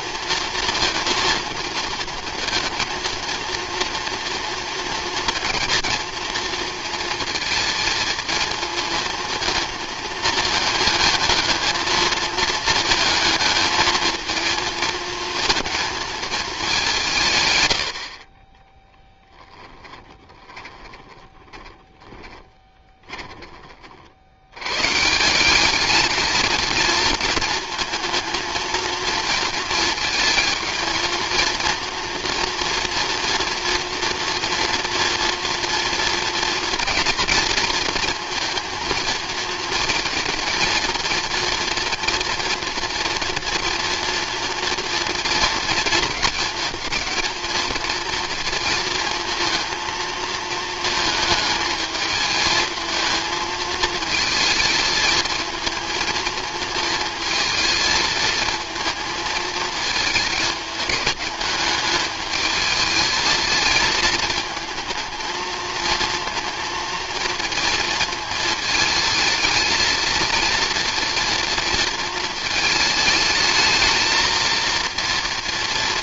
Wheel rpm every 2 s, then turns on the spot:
230, 220, 230, 220, 220, 230, 220, 230, 200, 10, 20, 30, 110, 220, 230, 230, 230, 230, 240, 230, 230, 230, 230, 220, 230, 220, 220, 220, 220, 220, 210, 220, 220, 230, 220, 230, 220, 230.
18-24